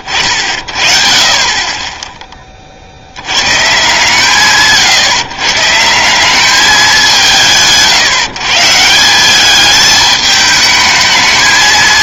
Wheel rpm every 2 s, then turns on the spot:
40, 30, 130, 200, 160, 210.
none